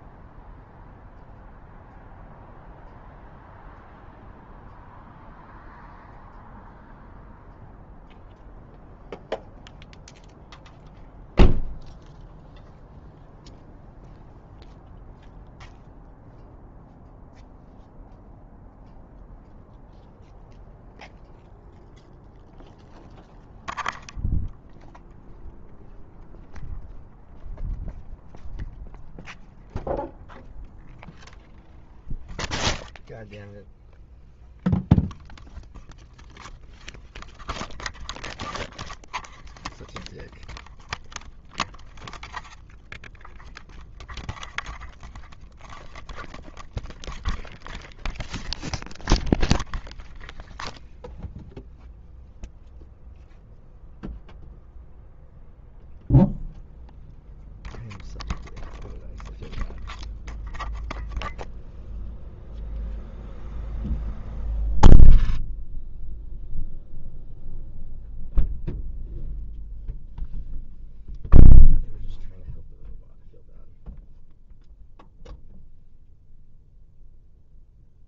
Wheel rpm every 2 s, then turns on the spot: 0, 0, 0, 0, 0, 0, 0, 0, 0, 0, 0, 0, 0, 0, 0, 0, 0, 0, 0, 0, 0, 0, 0, 0, 0, 0, 0, 0, 0, 0, 0, 0, 0, 0, 0, 0, 0, 0, 0.
none